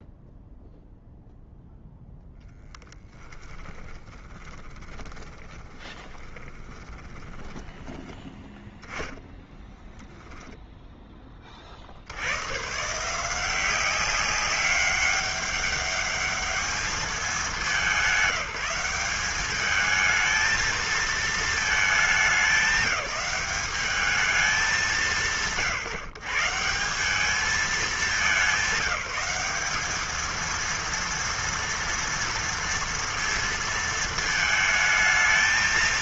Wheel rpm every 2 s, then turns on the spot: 0, 10, 30, 20, 10, 0, 110, 190, 210, 200, 220, 210, 210, 150, 180, 230, 230, 230.
4-8